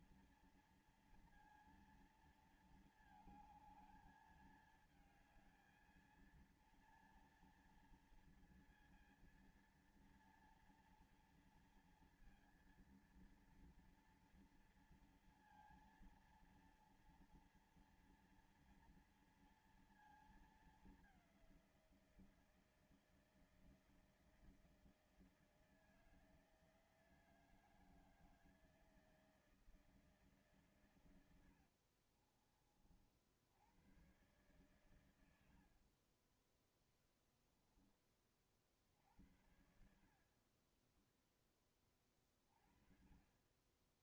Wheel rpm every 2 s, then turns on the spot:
230, 230, 220, 230, 230, 230, 230, 230, 230, 230, 230, 170, 160, 160, 160, 160, 50, 110, 50, 20, 50, 30.
32-34 36-38